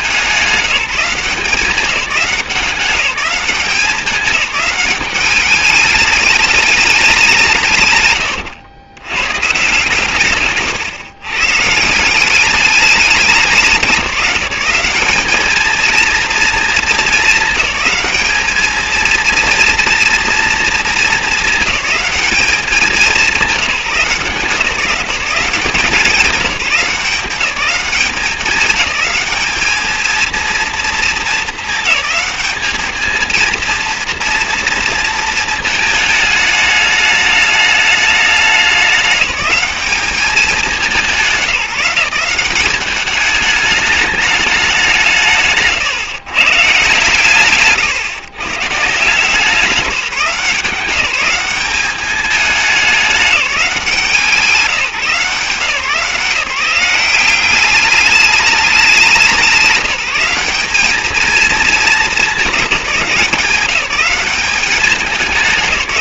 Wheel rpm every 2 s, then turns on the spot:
180, 190, 200, 210, 110, 130, 200, 180, 230, 220, 230, 210, 170, 180, 200, 230, 210, 230, 210, 200, 200, 190, 200, 140, 140, 180, 210, 170, 170, 210, 190, 200, 200.
8-10